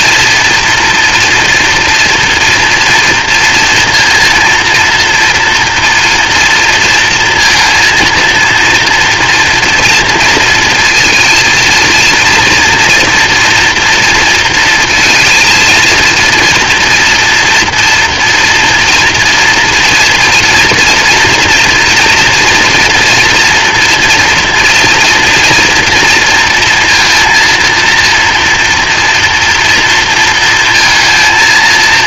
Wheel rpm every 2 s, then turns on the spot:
230, 230, 230, 230, 230, 230, 240, 230, 230, 240, 240, 230, 230, 230, 230, 230.
none